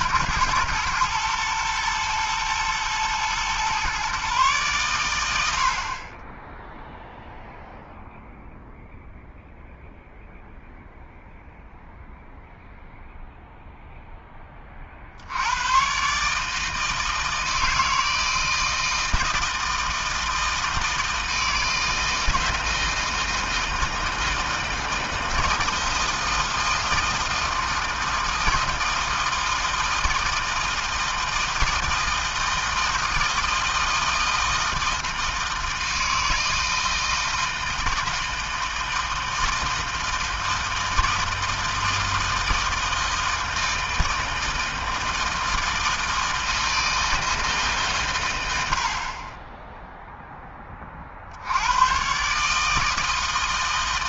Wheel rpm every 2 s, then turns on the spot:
110, 120, 100, 0, 0, 0, 0, 50, 160, 160, 160, 160, 160, 160, 160, 160, 160, 160, 160, 160, 160, 160, 160, 160, 40, 50, 160.
none